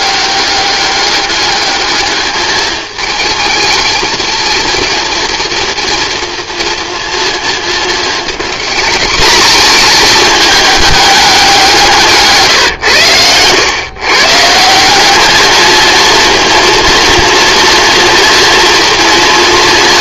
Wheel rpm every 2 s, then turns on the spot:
200, 210, 230, 230, 220, 210, 140, 160, 230, 230.
none